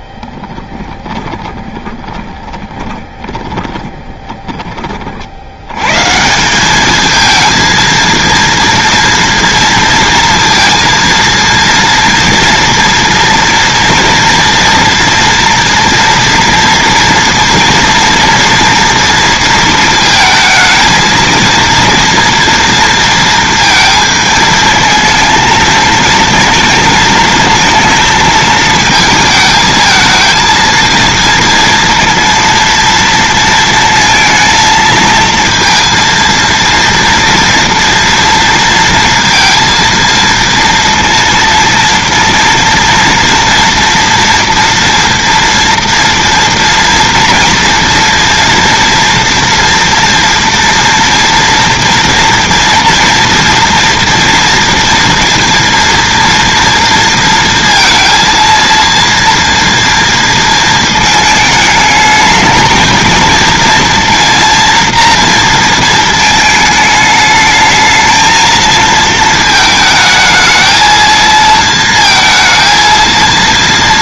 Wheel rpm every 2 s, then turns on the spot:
20, 20, 20, 190, 230, 230, 230, 230, 230, 230, 220, 230, 220, 230, 220, 230, 230, 230, 230, 230, 230, 230, 230, 230, 240, 230, 230, 230, 230, 230, 230, 220, 230, 220, 230, 220, 230.
0-4